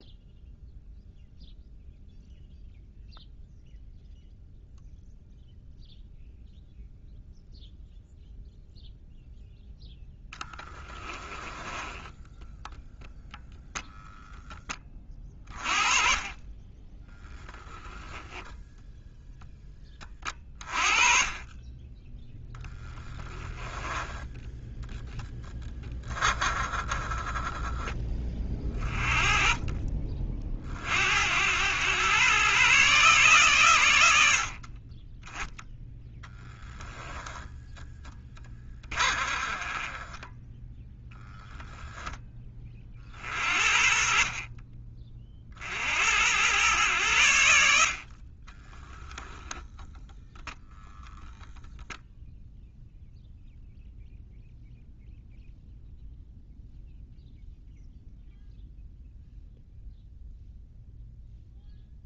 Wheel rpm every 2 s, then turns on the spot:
0, 0, 0, 0, 0, 10, 0, 30, 10, 0, 30, 10, 10, 20, 30, 70, 140, 20, 0, 20, 10, 50, 30, 100, 0, 0, 0, 0, 0, 0, 0.
10-12 16-18 22-24 38-40